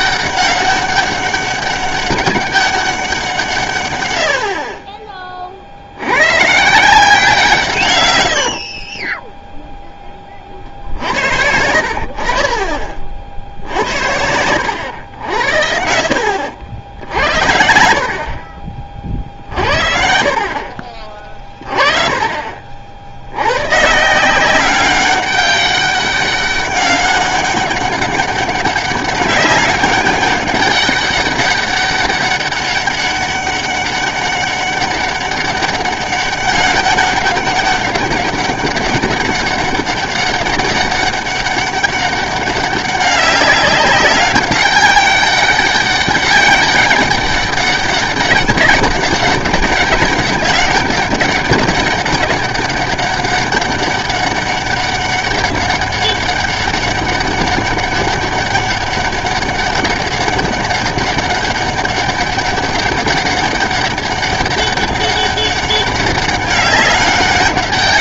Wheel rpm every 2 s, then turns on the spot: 200, 200, 50, 150, 60, 50, 40, 90, 80, 40, 40, 50, 190, 200, 200, 200, 200, 200, 200, 200, 200, 190, 200, 200, 200, 190, 200, 200, 200, 200, 200, 200, 200, 200.
8-10